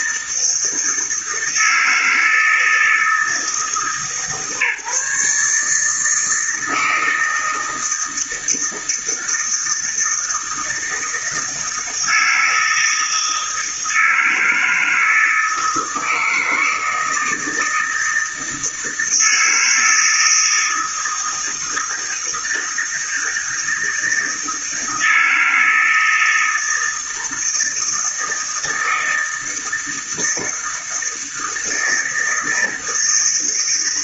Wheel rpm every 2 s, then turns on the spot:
160, 160, 150, 160, 160, 160, 160, 160, 160, 160, 160, 160, 160, 160, 160, 160, 160.
none